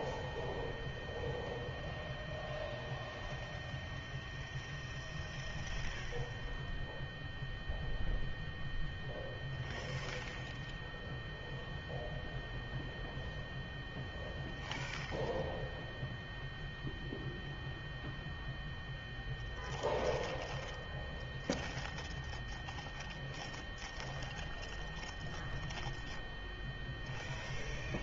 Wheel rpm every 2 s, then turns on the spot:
0, 0, 0, 0, 0, 0, 0, 0, 0, 0, 0, 0, 0, 0.
none